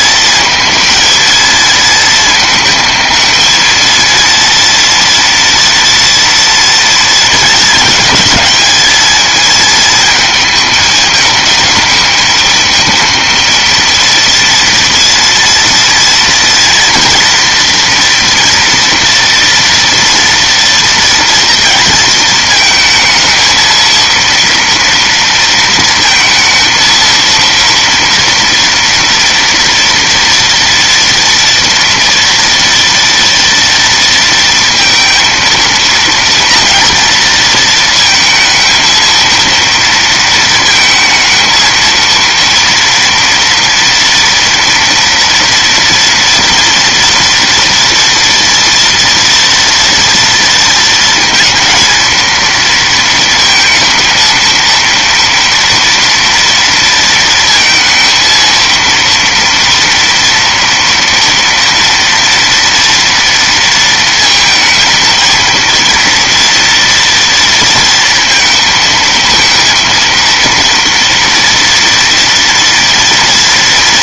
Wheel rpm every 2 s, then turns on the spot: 230, 220, 230, 230, 220, 220, 220, 230, 230, 230, 230, 220, 230, 230, 240, 230, 230, 230, 230, 230, 220, 230, 230, 230, 230, 230, 230, 230, 230, 230, 230, 230, 230, 230, 230, 230, 230.
none